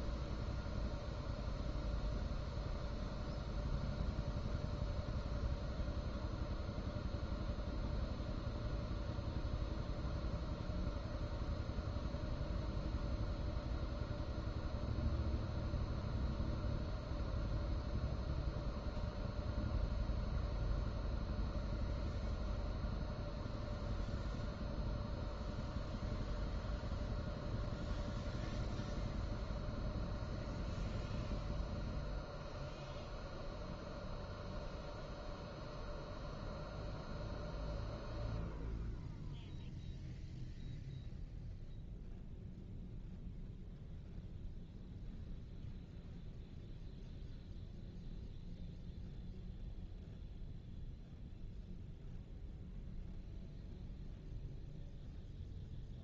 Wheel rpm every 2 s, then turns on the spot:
0, 0, 0, 0, 0, 0, 0, 0, 0, 0, 0, 0, 0, 0, 0, 0, 0, 0, 0, 0, 0, 0, 0, 0, 0, 0, 0, 0.
none